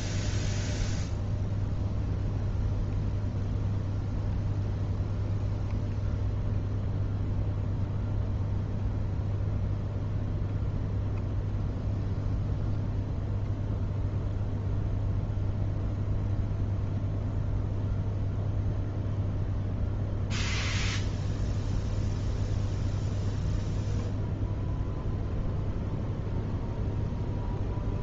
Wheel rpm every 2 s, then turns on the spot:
0, 0, 0, 0, 0, 0, 0, 0, 0, 0, 0, 0, 0, 0.
none